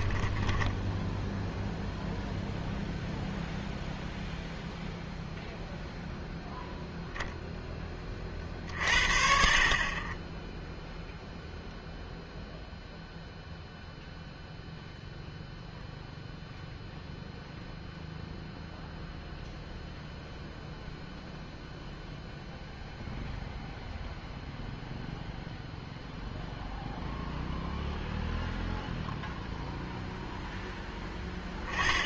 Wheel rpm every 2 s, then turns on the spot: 10, 0, 0, 0, 50, 0, 0, 0, 0, 0, 0, 0, 0, 0, 0, 0.
0-2